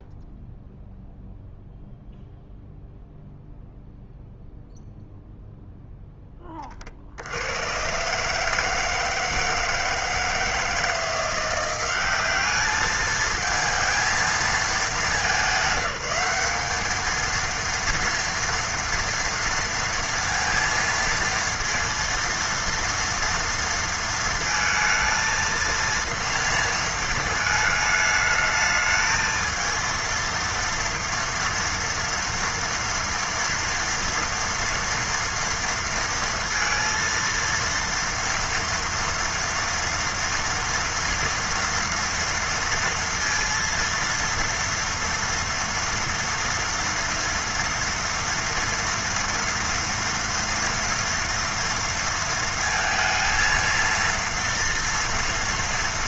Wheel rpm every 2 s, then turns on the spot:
0, 0, 0, 20, 150, 160, 200, 220, 200, 230, 230, 230, 230, 230, 220, 230, 230, 230, 230, 230, 230, 230, 230, 230, 230, 230, 230, 230.
none